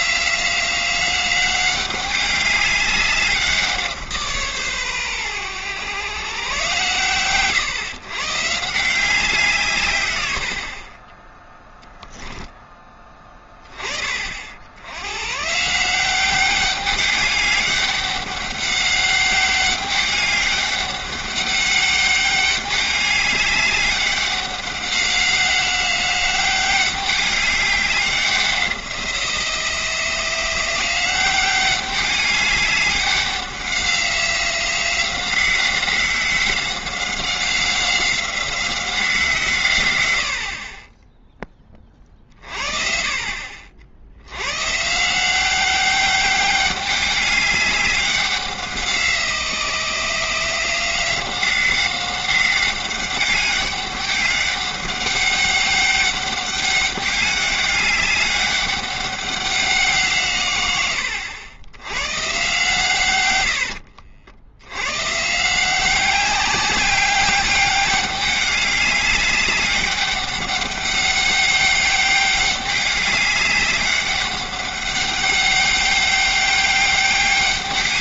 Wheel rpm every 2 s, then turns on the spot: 180, 200, 130, 130, 160, 60, 10, 70, 200, 200, 200, 200, 190, 190, 180, 180, 200, 180, 190, 180, 40, 40, 130, 200, 180, 170, 190, 200, 200, 200, 110, 130, 90, 190, 200, 200, 200, 200, 200.
none